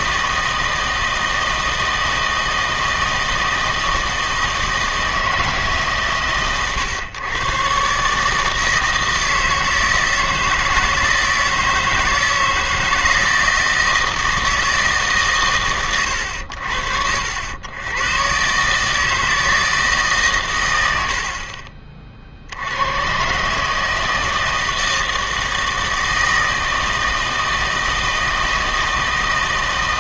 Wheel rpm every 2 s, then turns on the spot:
160, 160, 160, 120, 160, 160, 160, 160, 70, 140, 120, 80, 160, 160, 160.
none